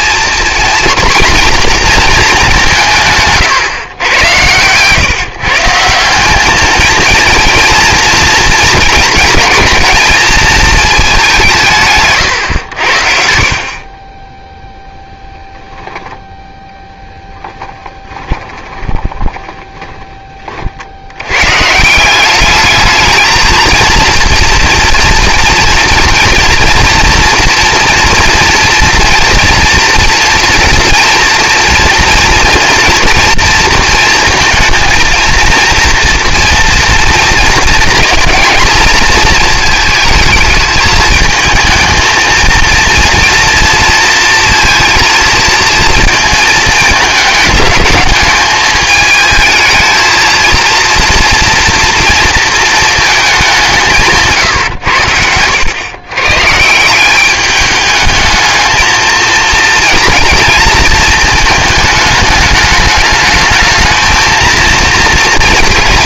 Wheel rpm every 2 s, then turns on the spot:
230, 210, 110, 190, 230, 220, 130, 20, 0, 20, 50, 210, 230, 230, 230, 230, 230, 230, 230, 230, 220, 230, 230, 220, 210, 230, 220, 120, 170, 220, 230, 210, 230.
4-6 18-20